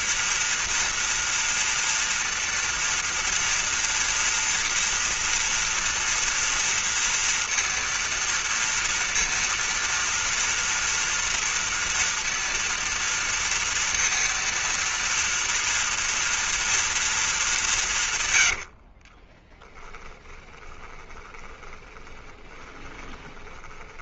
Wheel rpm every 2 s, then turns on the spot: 230, 230, 230, 230, 230, 230, 230, 230, 230, 40, 20, 30.
18-24